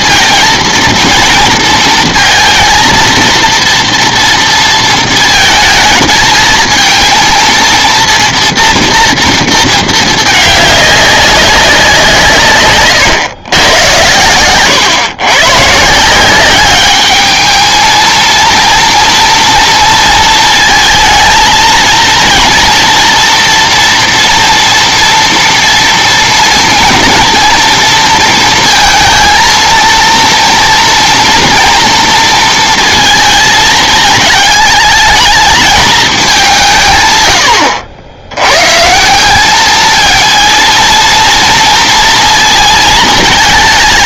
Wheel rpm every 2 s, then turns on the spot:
230, 230, 230, 220, 230, 210, 140, 120, 200, 230, 230, 230, 240, 230, 230, 230, 230, 210, 170, 120, 230, 230.
none